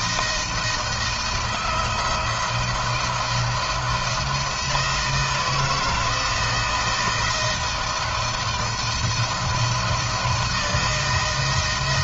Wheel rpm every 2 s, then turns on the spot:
170, 170, 160, 160, 170, 160.
none